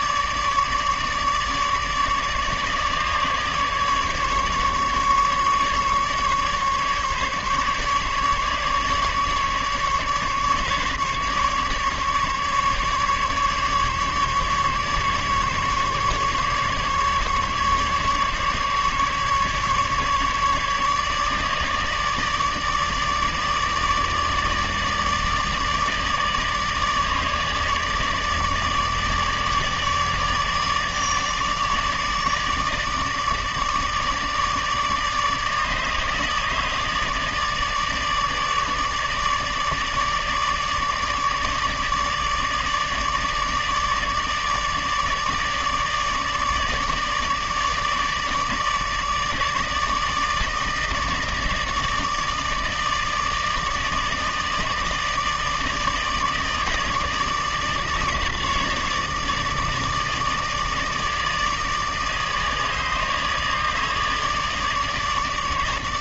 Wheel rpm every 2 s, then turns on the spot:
150, 150, 150, 150, 150, 150, 150, 150, 140, 140, 150, 150, 150, 150, 150, 150, 150, 150, 150, 150, 150, 150, 150, 150, 150, 160, 150, 160, 150, 150, 150, 150, 150.
none